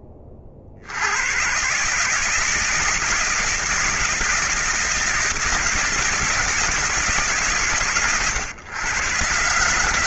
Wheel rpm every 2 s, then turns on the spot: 30, 160, 170, 160, 110.
none